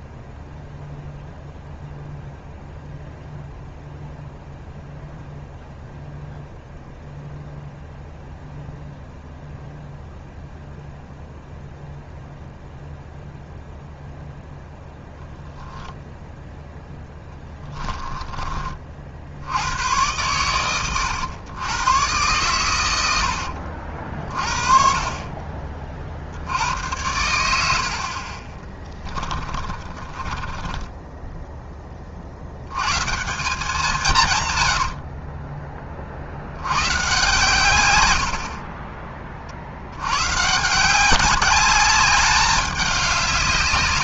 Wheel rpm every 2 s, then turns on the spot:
0, 0, 0, 0, 0, 0, 0, 0, 0, 30, 100, 120, 40, 70, 20, 20, 70, 120, 90, 40, 160, 200.
28-32 34-36